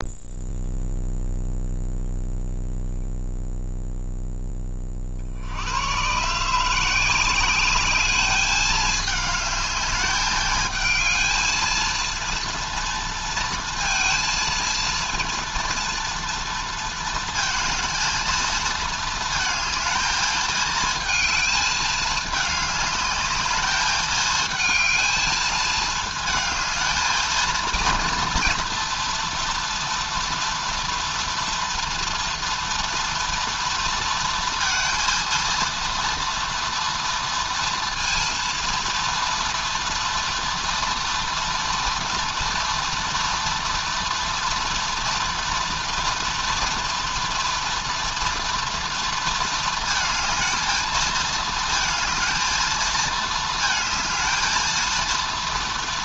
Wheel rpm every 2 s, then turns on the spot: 0, 0, 40, 180, 210, 220, 230, 230, 230, 220, 220, 210, 220, 220, 240, 230, 230, 230, 230, 230, 240, 230, 230, 240, 230, 220, 220, 230.
none